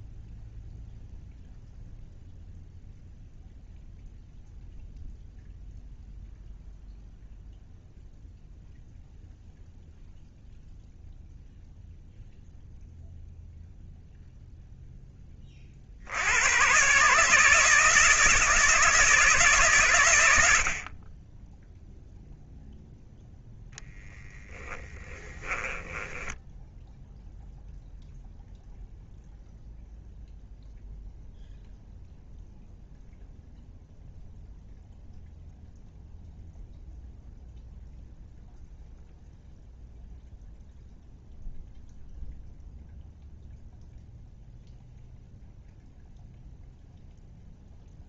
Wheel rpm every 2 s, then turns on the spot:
0, 0, 0, 0, 0, 0, 0, 10, 140, 160, 40, 0, 10, 0, 0, 0, 0, 0, 0, 0, 0, 0, 0, 0.
24-26